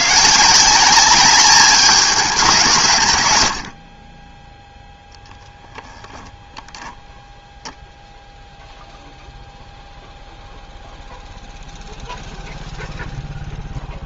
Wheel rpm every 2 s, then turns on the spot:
190, 150, 0, 10, 0, 0, 0.
none